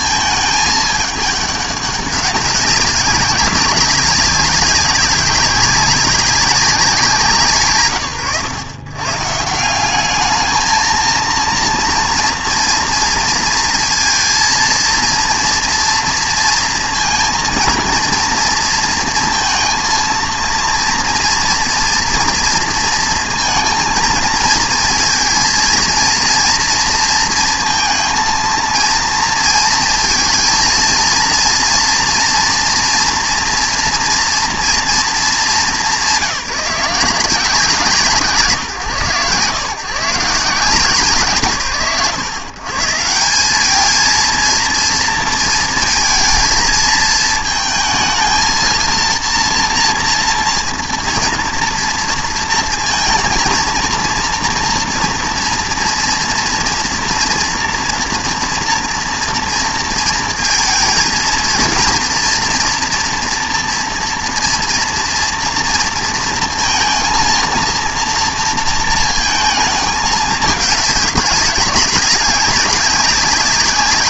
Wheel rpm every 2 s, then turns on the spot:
220, 200, 200, 200, 120, 220, 230, 230, 230, 230, 230, 230, 220, 230, 230, 230, 230, 230, 190, 130, 160, 140, 230, 220, 230, 230, 230, 230, 230, 230, 230, 230, 230, 230, 230, 210, 190.
none